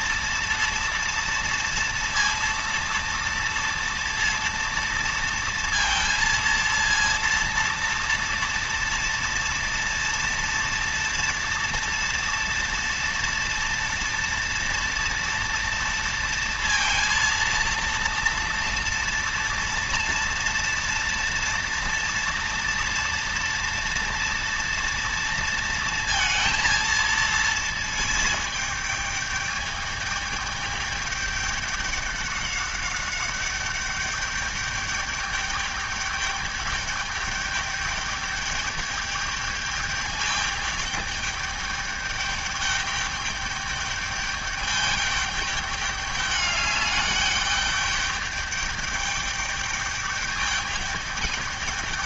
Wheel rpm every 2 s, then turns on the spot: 230, 230, 230, 230, 230, 230, 230, 230, 230, 230, 230, 230, 230, 230, 210, 210, 200, 210, 210, 210, 210, 210, 210, 210, 210, 210.
none